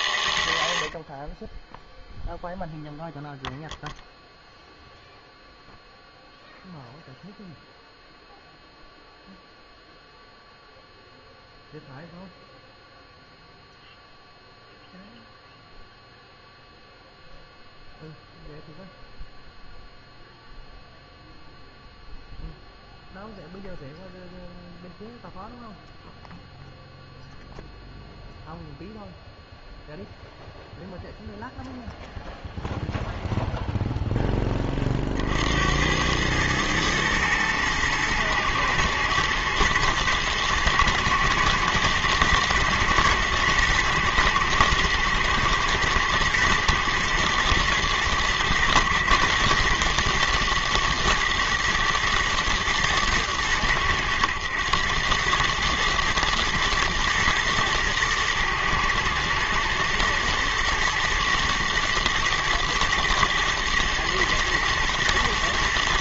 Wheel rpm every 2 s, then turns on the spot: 20, 0, 0, 0, 0, 0, 0, 0, 0, 0, 0, 0, 0, 0, 0, 0, 0, 20, 110, 110, 110, 120, 120, 120, 110, 110, 110, 100, 110, 110, 110, 110, 110.
none